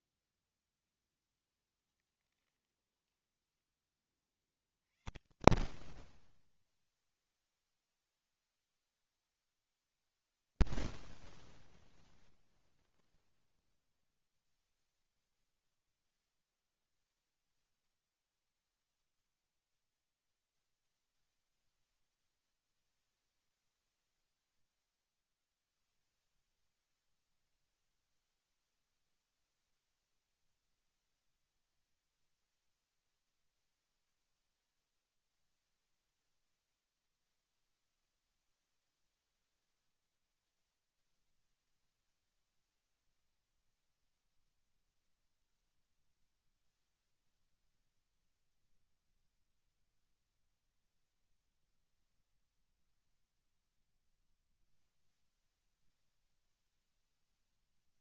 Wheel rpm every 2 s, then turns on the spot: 0, 0, 0, 0, 0, 0, 0, 0, 0, 0, 0, 0, 0, 0, 0, 0, 0, 0, 0, 0, 0, 0, 0, 0, 0, 0, 0, 0, 0.
none